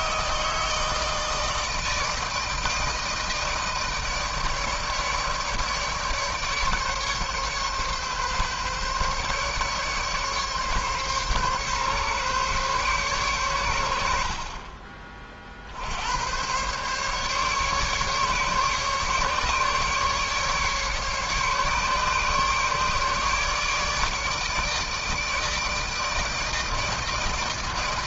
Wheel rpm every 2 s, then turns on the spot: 160, 160, 150, 150, 140, 140, 140, 50, 110, 140, 150, 150, 150, 160.
none